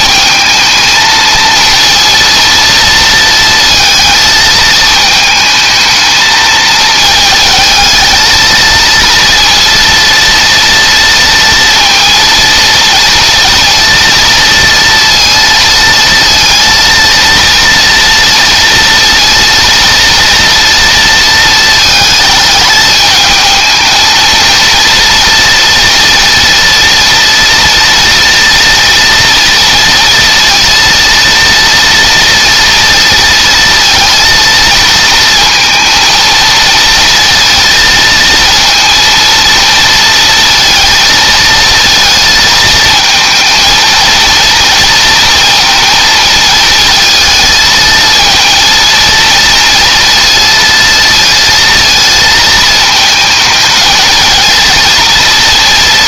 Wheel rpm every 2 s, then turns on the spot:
220, 230, 220, 220, 230, 230, 230, 230, 230, 230, 230, 210, 230, 230, 230, 230, 230, 230, 230, 230, 220, 220, 230, 220, 230, 230, 220, 230.
none